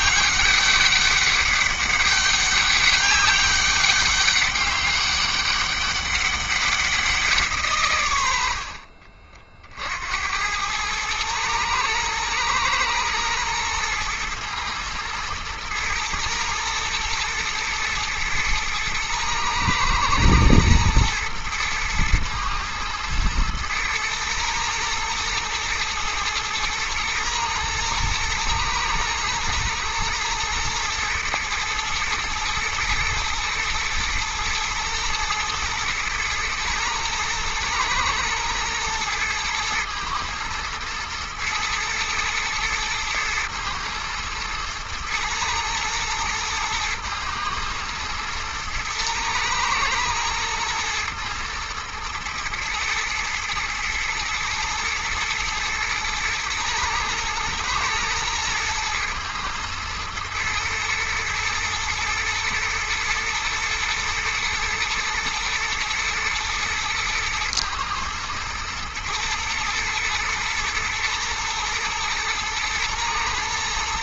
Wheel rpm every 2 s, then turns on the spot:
200, 200, 200, 130, 60, 110, 120, 110, 110, 110, 120, 110, 110, 110, 110, 110, 120, 110, 120, 110, 110, 110, 120, 110, 110, 110, 110, 110, 110, 110, 110, 110, 110, 110, 120, 120, 120.
none